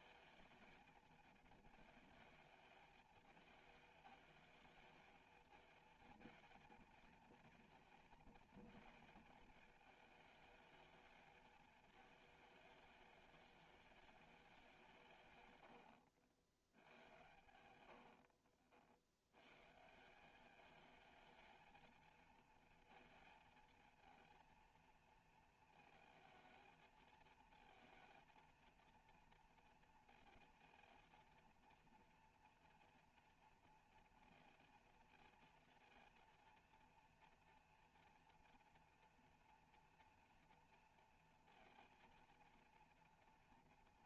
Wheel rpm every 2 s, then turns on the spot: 220, 220, 220, 230, 230, 220, 210, 190, 100, 60, 210, 230, 230, 220, 230, 230, 230, 230, 230, 230, 230, 230.
none